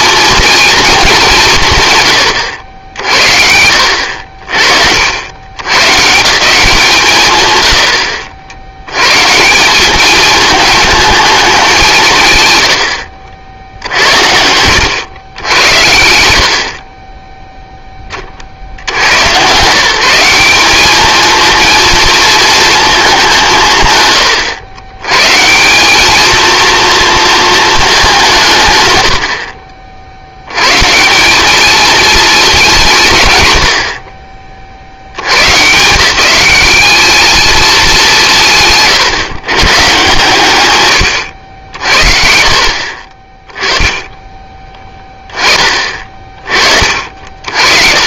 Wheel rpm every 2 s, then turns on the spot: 220, 80, 60, 170, 80, 220, 100, 90, 50, 70, 200, 220, 110, 230, 140, 120, 190, 60, 200, 150, 120, 50, 20, 40.
12-14 38-40 46-48